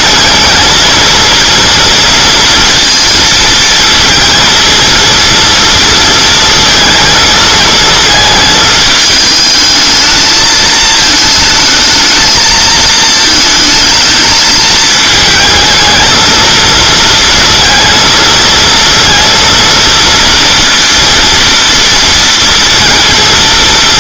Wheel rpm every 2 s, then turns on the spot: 220, 230, 230, 230, 220, 220, 220, 220, 230, 230, 230, 230.
none